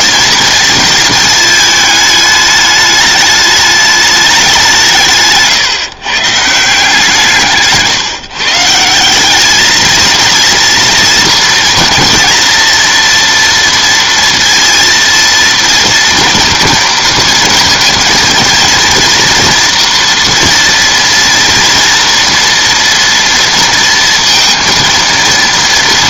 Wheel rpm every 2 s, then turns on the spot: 220, 210, 150, 170, 180, 230, 230, 230, 230, 230, 230, 230, 230.
none